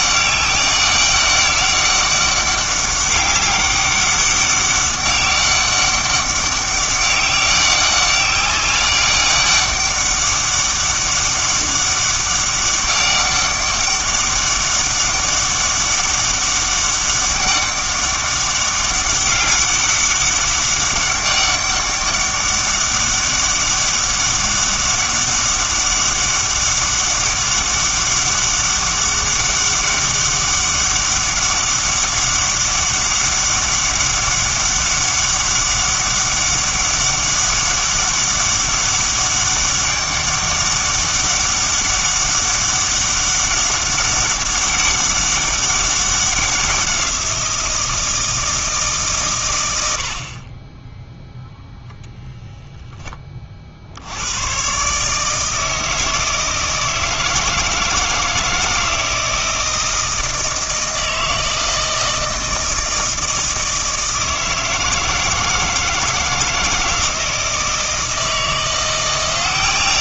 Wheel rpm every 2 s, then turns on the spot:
200, 200, 200, 190, 190, 200, 200, 200, 200, 200, 200, 200, 200, 200, 200, 200, 200, 200, 200, 200, 200, 200, 200, 180, 150, 10, 0, 130, 160, 160, 160, 160, 160, 160, 170.
none